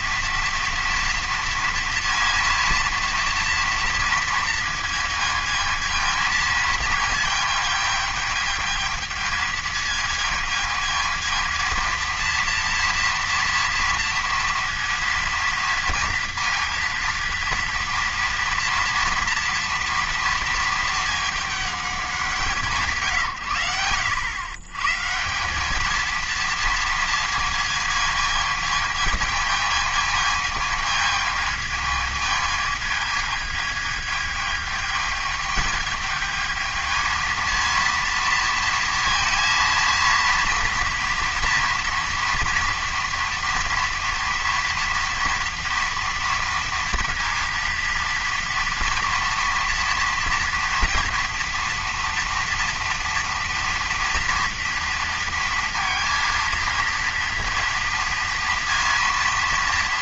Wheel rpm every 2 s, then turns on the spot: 230, 230, 230, 220, 220, 220, 230, 230, 230, 230, 220, 140, 140, 230, 220, 220, 220, 210, 220, 230, 230, 230, 230, 230, 230, 230, 230, 230, 230, 230.
none